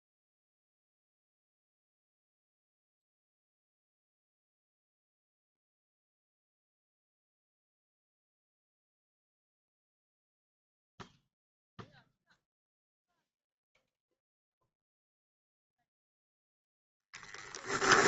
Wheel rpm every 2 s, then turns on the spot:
0, 0, 0, 0, 0, 0, 0, 0, 0.
none